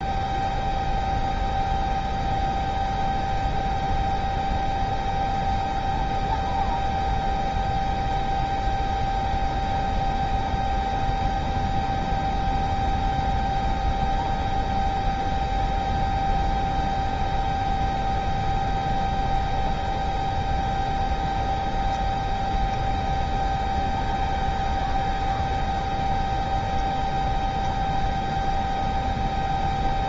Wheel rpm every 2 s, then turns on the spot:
0, 0, 0, 0, 0, 0, 0, 0, 0, 0, 0, 0, 0, 0, 0.
none